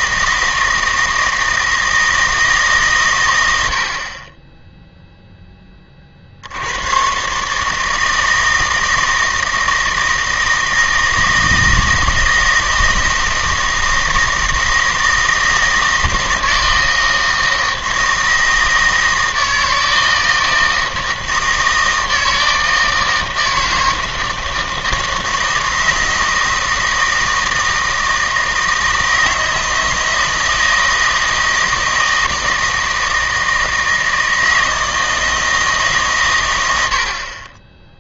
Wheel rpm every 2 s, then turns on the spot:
160, 150, 0, 90, 160, 160, 160, 160, 160, 160, 160, 160, 160, 160, 160, 160, 160, 160, 90.
none